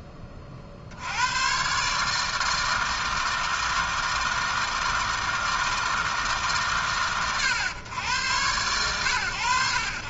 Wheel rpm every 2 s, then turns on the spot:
80, 160, 160, 140, 100.
none